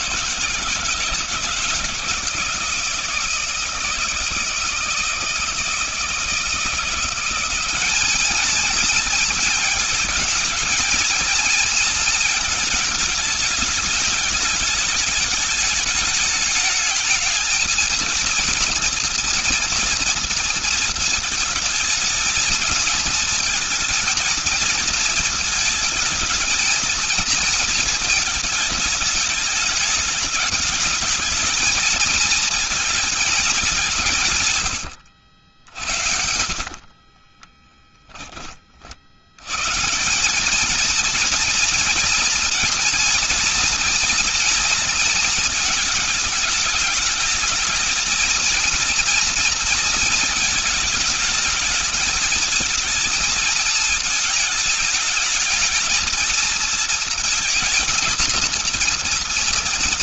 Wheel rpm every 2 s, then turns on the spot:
160, 160, 160, 170, 220, 220, 220, 210, 210, 230, 230, 230, 230, 230, 220, 220, 220, 130, 60, 30, 210, 240, 230, 210, 230, 230, 220, 220, 220, 230.
34-38